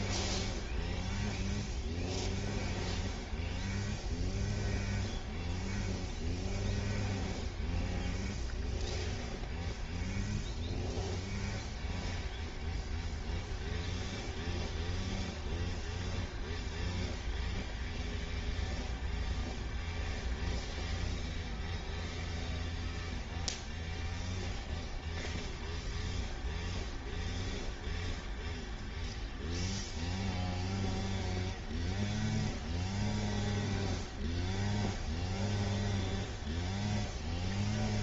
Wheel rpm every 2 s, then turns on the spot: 0, 0, 0, 0, 0, 0, 0, 0, 0, 0, 0, 0, 0, 0, 0, 0, 0, 0, 0.
none